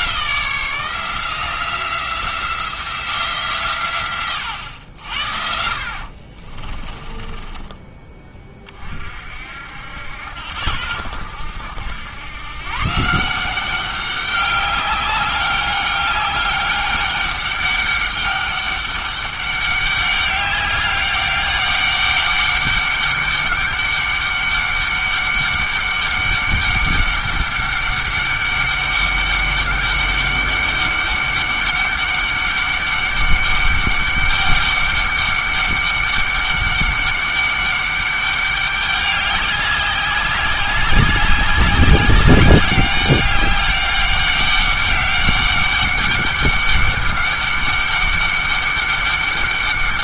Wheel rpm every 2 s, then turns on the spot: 170, 170, 100, 40, 30, 80, 140, 200, 200, 200, 200, 200, 200, 200, 200, 200, 200, 200, 200, 200, 190, 190, 200, 200, 200.
6-8